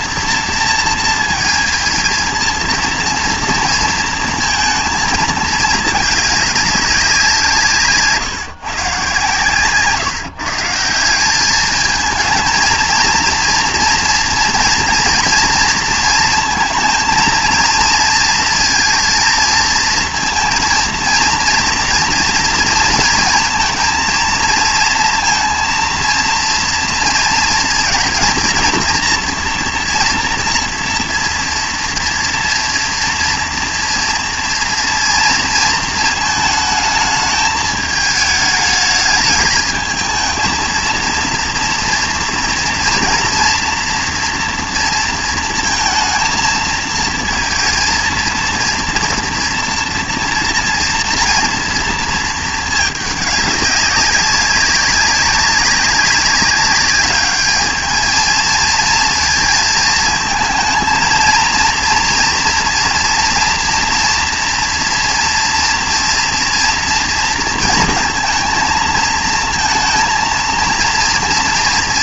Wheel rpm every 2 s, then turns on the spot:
230, 230, 230, 200, 150, 150, 220, 230, 230, 230, 230, 230, 230, 240, 230, 230, 240, 230, 220, 210, 230, 230, 230, 230, 230, 230, 220, 190, 200, 230, 220, 230, 230, 230, 220, 230.
none